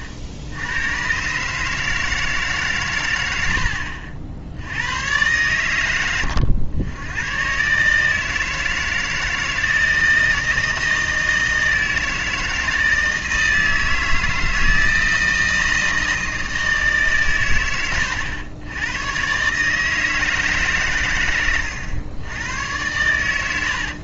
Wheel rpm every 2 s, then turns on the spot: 50, 140, 90, 90, 160, 160, 160, 160, 160, 100, 150, 100.
none